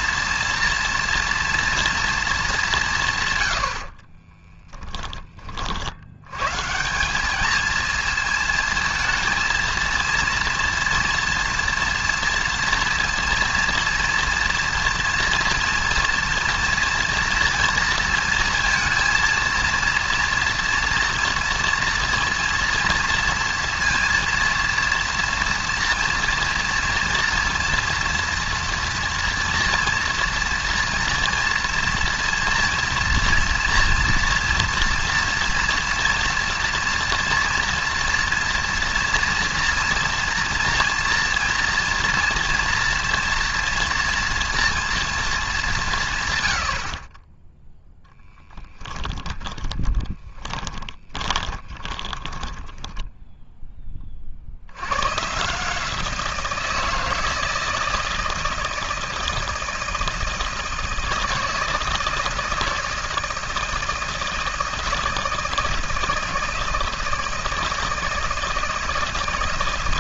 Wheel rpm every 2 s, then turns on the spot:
230, 180, 10, 170, 230, 230, 230, 230, 230, 230, 230, 230, 230, 230, 230, 230, 240, 230, 230, 230, 230, 230, 230, 60, 20, 20, 10, 100, 160, 160, 160, 160, 160, 160, 160.
4-6 48-54